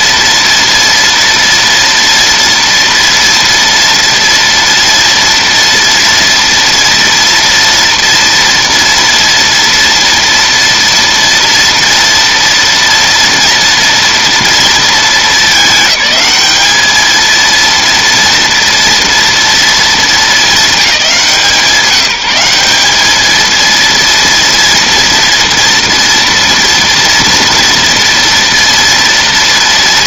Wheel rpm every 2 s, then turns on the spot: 230, 230, 230, 230, 230, 230, 230, 230, 210, 240, 210, 180, 230, 230, 230.
none